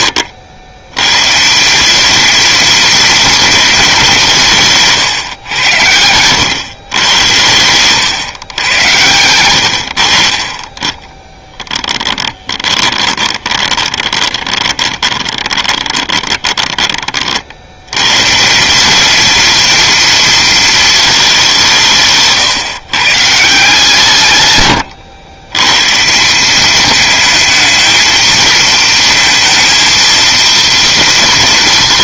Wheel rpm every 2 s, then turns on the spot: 100, 230, 150, 120, 110, 20, 20, 20, 20, 190, 220, 130, 110, 210, 230, 230.
12-16